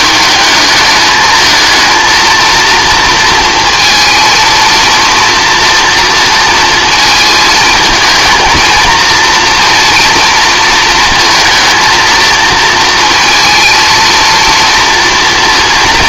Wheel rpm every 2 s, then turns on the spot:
220, 230, 230, 220, 230, 220, 230, 230.
none